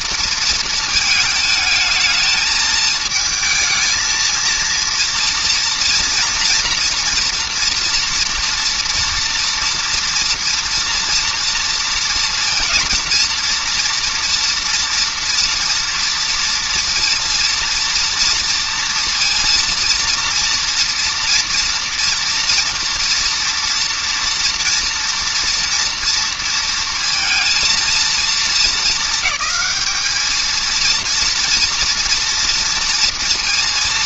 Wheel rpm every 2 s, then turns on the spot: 230, 220, 230, 230, 240, 230, 230, 230, 230, 230, 230, 230, 230, 230, 220, 220, 230.
none